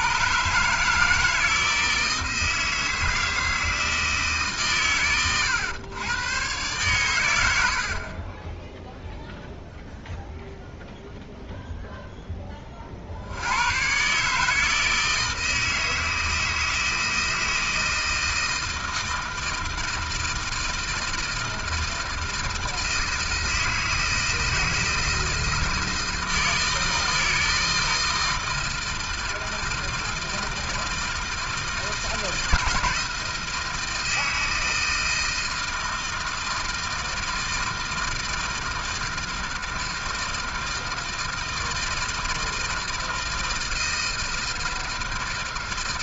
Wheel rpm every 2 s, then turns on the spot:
150, 160, 140, 120, 10, 0, 20, 150, 160, 160, 160, 160, 160, 160, 160, 160, 160, 160, 160, 160, 160, 160, 160.
none